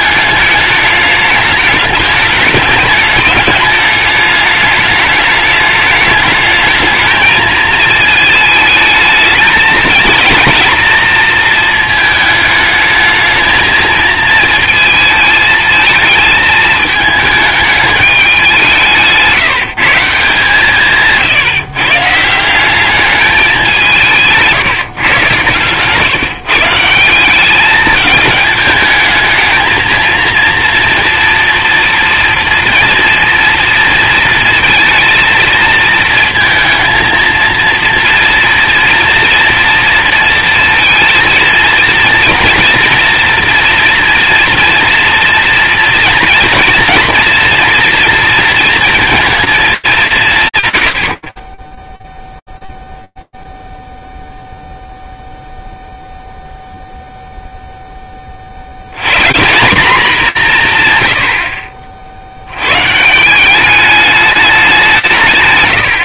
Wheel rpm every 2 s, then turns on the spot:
210, 210, 210, 220, 220, 230, 220, 220, 220, 190, 160, 180, 150, 150, 220, 230, 230, 230, 220, 230, 230, 230, 230, 230, 230, 130, 0, 0, 0, 100, 110, 150, 160.
none